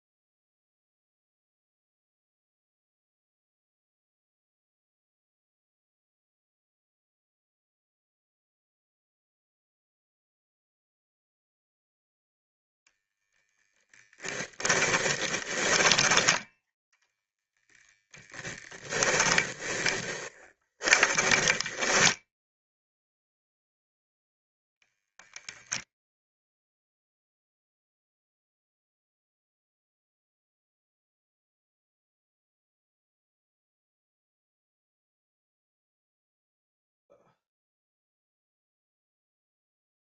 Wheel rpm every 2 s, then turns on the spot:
0, 0, 0, 0, 0, 0, 0, 30, 0, 20, 20, 0, 0, 0, 0, 0, 0, 0, 0, 0.
14-16 18-22